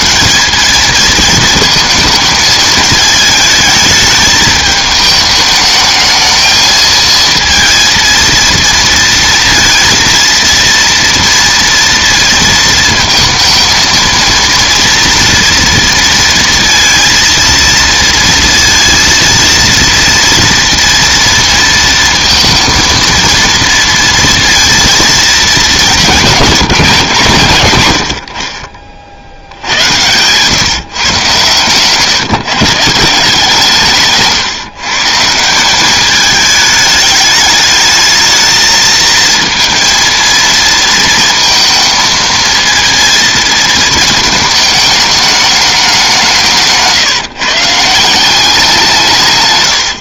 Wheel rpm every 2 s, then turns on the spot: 200, 220, 210, 220, 230, 230, 230, 230, 230, 230, 230, 230, 230, 180, 60, 130, 150, 150, 210, 220, 230, 230, 220, 150, 180.
46-48